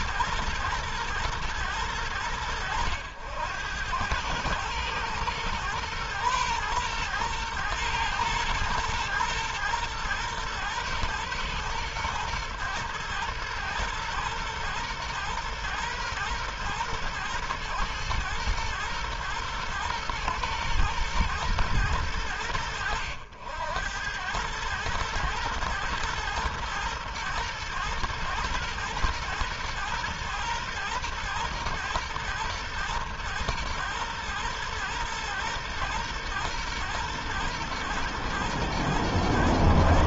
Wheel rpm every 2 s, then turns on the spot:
110, 90, 110, 120, 110, 120, 110, 120, 110, 120, 110, 80, 110, 120, 120, 120, 120, 120, 110, 120.
none